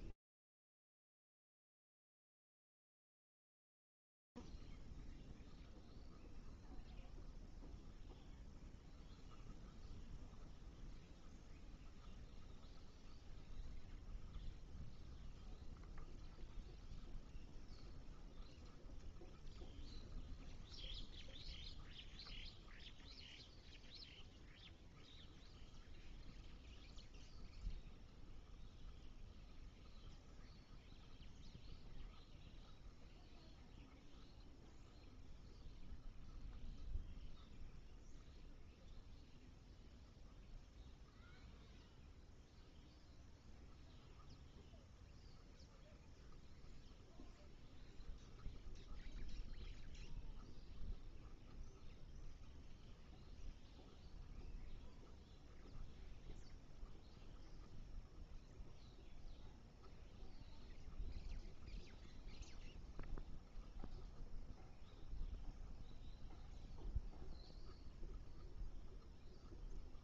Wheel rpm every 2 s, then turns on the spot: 0, 0, 0, 0, 0, 0, 0, 0, 0, 0, 0, 0, 0, 0, 0, 0, 0, 0, 0, 0, 0, 0, 0, 0, 0, 0, 0, 0, 0, 0, 0, 0, 0, 0, 0.
none